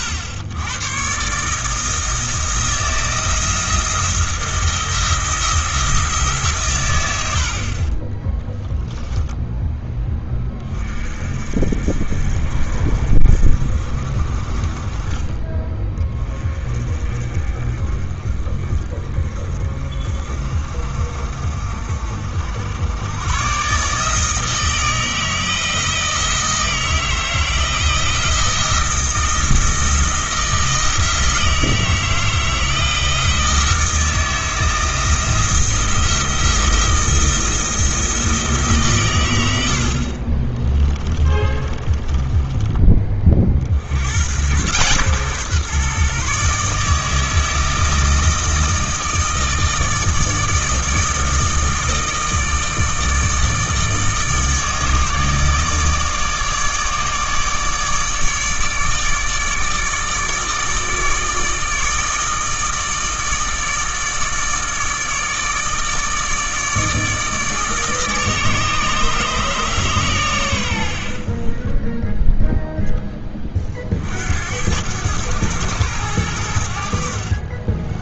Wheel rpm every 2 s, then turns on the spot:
100, 160, 170, 140, 10, 30, 50, 30, 30, 40, 50, 70, 160, 160, 170, 160, 160, 170, 160, 150, 30, 20, 120, 150, 160, 160, 160, 150, 150, 150, 160, 160, 160, 150, 150, 100, 10, 80, 80.
40-42